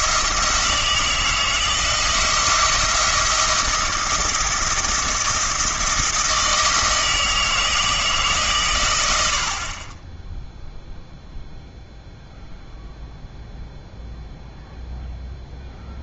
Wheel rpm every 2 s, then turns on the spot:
160, 170, 170, 160, 110, 0, 0, 0.
none